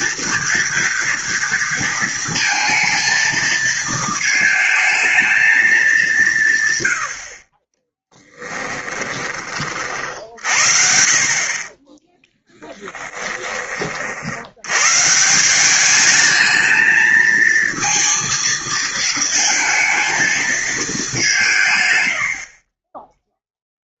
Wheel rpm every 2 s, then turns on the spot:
230, 220, 220, 110, 10, 60, 10, 120, 220, 230, 210, 30.
8-10 12-14